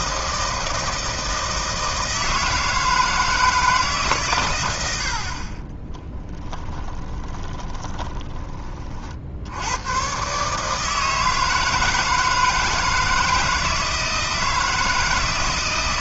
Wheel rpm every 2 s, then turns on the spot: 160, 160, 100, 20, 40, 150, 160, 160.
6-8